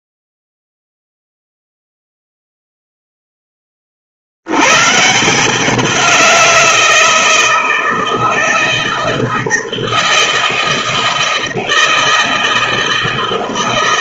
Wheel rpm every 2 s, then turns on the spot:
0, 0, 100, 170, 160, 160, 160.
none